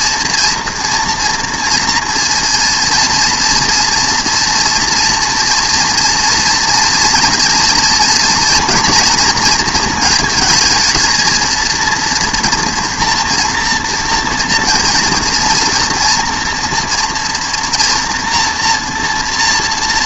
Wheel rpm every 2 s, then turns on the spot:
230, 230, 230, 240, 240, 230, 240, 230, 230, 230.
none